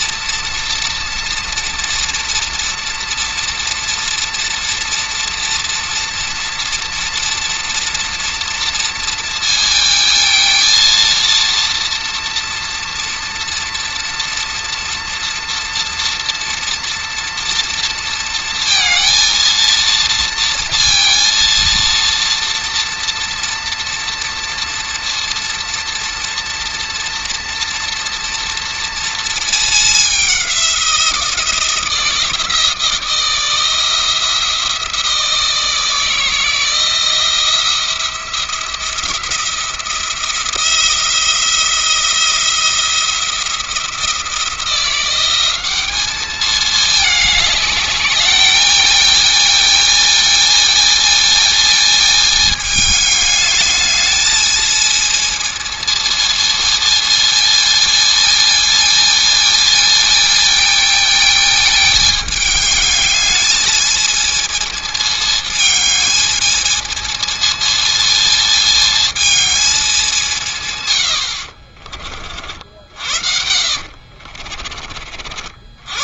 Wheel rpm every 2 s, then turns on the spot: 230, 230, 230, 230, 230, 230, 230, 240, 230, 230, 230, 230, 230, 230, 230, 180, 170, 170, 160, 170, 170, 170, 170, 210, 220, 230, 210, 220, 230, 220, 220, 210, 220, 220, 220, 100, 60, 40.
72-74